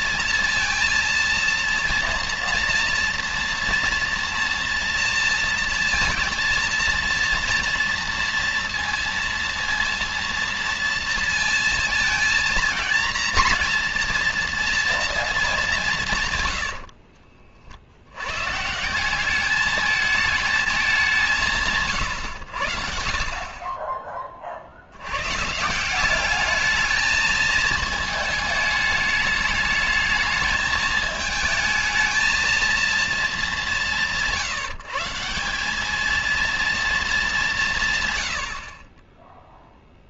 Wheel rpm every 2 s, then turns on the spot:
230, 230, 230, 230, 230, 230, 230, 230, 100, 130, 220, 100, 50, 210, 210, 220, 230, 160, 230, 60.
16-18